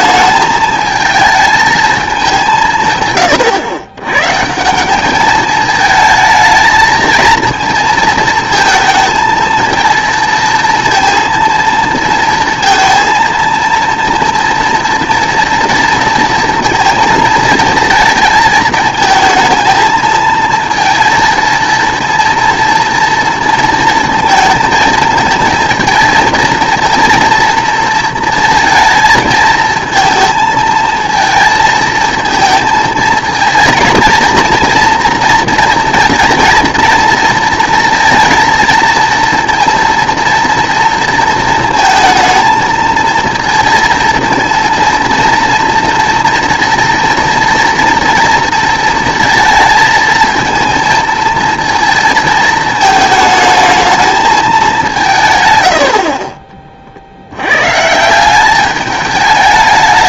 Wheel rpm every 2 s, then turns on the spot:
220, 150, 160, 220, 230, 230, 230, 230, 230, 220, 230, 230, 220, 230, 230, 230, 220, 230, 230, 230, 230, 230, 230, 230, 230, 220, 220, 200, 40, 200.
none